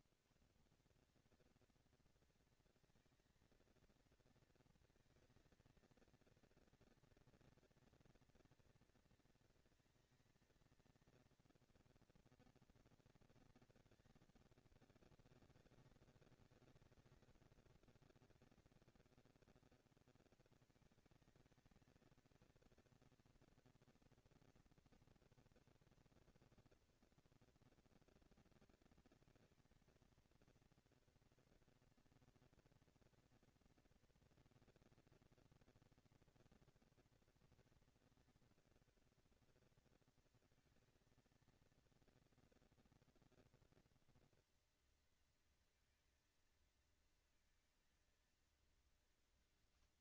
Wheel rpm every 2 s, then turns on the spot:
110, 230, 230, 230, 230, 220, 230, 200, 200, 200, 220, 230, 230, 230, 230, 230, 230, 230, 230, 230, 230, 230, 230, 220, 220.
none